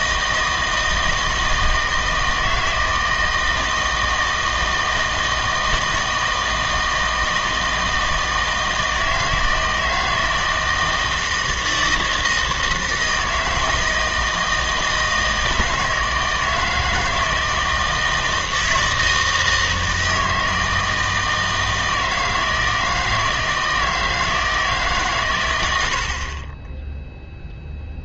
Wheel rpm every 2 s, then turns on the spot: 160, 160, 160, 160, 160, 160, 160, 160, 160, 160, 160, 160, 160, 30.
none